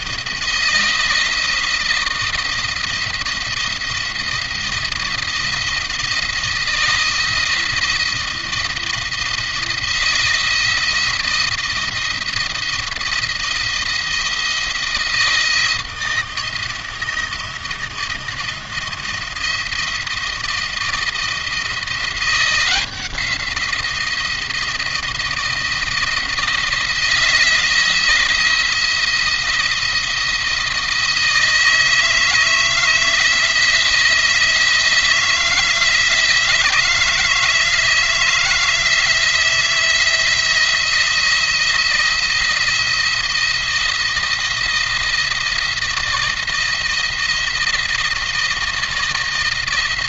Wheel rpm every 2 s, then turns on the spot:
170, 170, 170, 160, 170, 170, 170, 160, 160, 160, 170, 170, 170, 160, 170, 160, 160, 160, 160, 160, 160, 170, 170, 170, 170.
none